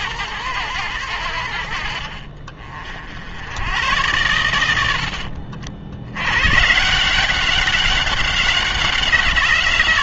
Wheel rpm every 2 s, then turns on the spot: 100, 50, 80, 150, 180.
none